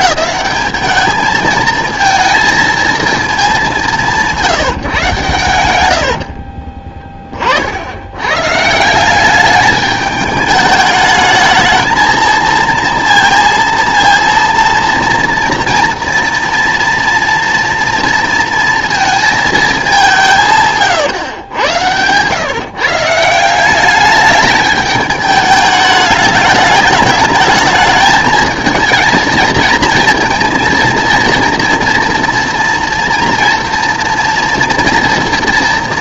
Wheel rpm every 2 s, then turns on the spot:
220, 230, 160, 40, 160, 210, 230, 230, 230, 230, 130, 140, 210, 210, 220, 230, 240, 240.
6-8 20-22